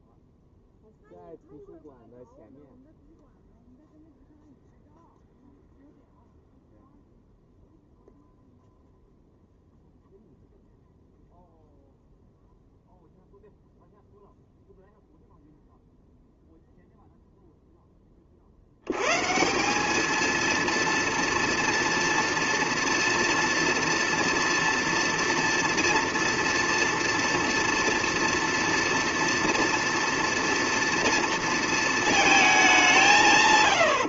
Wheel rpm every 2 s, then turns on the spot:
0, 0, 0, 0, 0, 0, 0, 0, 0, 70, 230, 230, 230, 230, 230, 230, 170.
none